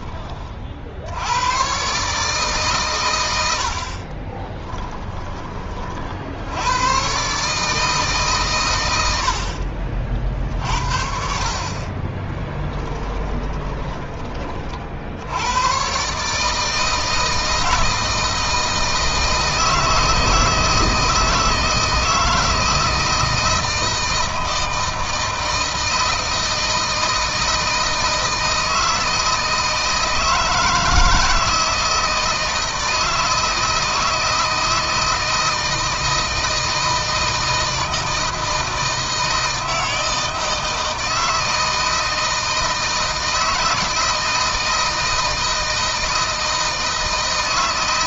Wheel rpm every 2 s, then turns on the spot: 70, 120, 20, 110, 100, 60, 20, 50, 160, 160, 160, 160, 160, 160, 160, 160, 160, 160, 160, 160, 160, 160, 160, 160.
4-6 12-14